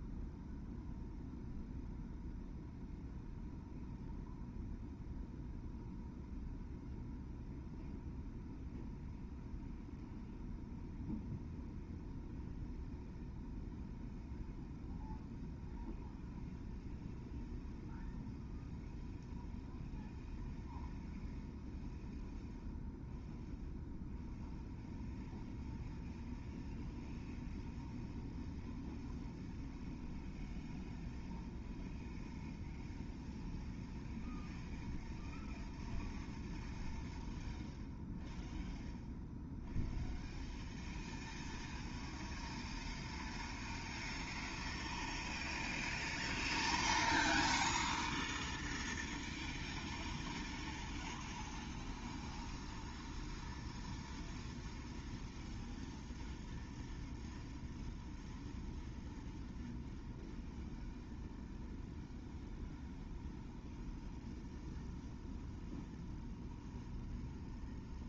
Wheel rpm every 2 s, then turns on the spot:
0, 0, 0, 0, 0, 0, 0, 0, 0, 0, 0, 0, 0, 0, 0, 0, 0, 0, 0, 0, 0, 0, 0, 0, 0, 0, 0, 0, 0, 0, 0, 0, 0, 0.
none